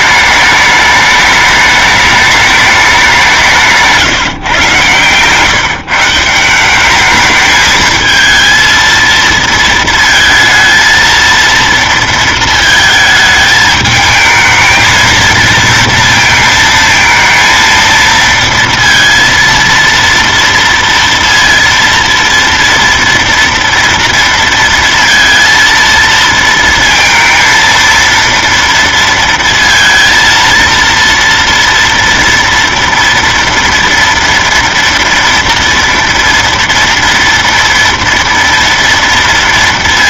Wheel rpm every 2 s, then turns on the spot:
210, 210, 140, 190, 230, 230, 220, 230, 220, 230, 230, 230, 230, 230, 230, 230, 230, 230, 230, 230.
none